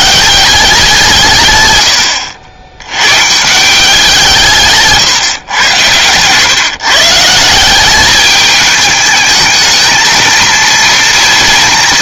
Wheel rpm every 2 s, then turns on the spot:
180, 80, 150, 140, 210, 230.
none